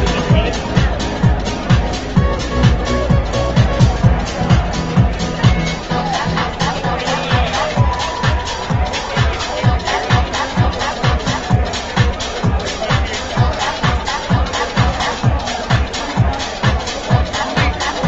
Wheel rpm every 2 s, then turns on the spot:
0, 0, 0, 0, 0, 0, 0, 0, 0.
none